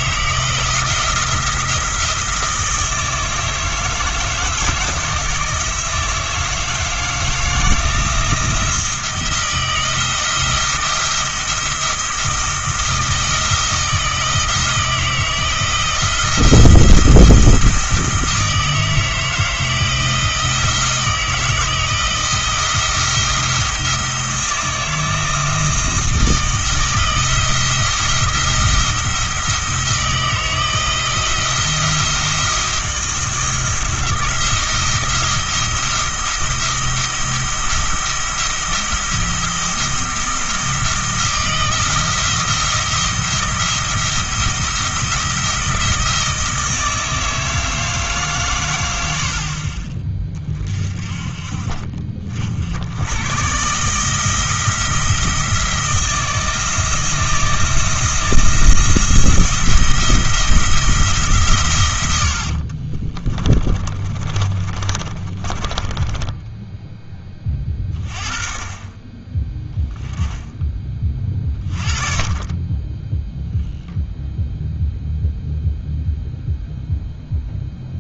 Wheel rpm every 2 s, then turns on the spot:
170, 160, 160, 160, 170, 170, 170, 170, 170, 160, 160, 170, 160, 160, 170, 160, 170, 170, 170, 170, 170, 170, 170, 160, 120, 40, 80, 160, 160, 170, 170, 60, 40, 10, 20, 20, 20, 0, 0.
62-66